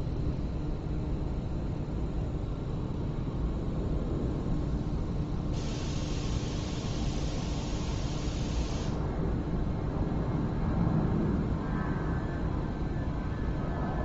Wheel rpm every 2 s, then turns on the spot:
0, 0, 0, 0, 0, 0, 0.
none